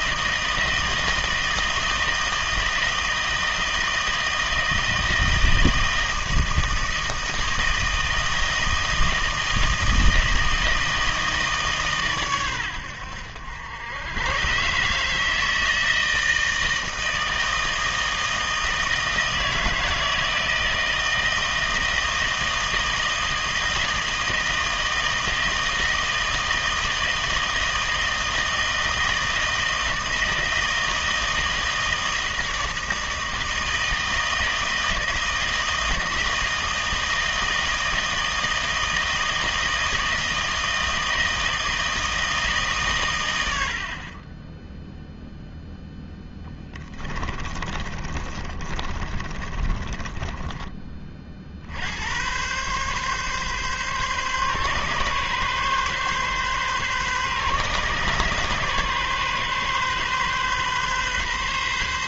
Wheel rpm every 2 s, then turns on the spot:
160, 160, 160, 160, 160, 160, 100, 140, 160, 160, 160, 160, 160, 160, 160, 160, 160, 160, 160, 160, 160, 140, 0, 20, 30, 20, 130, 130, 130, 140, 130.
46-50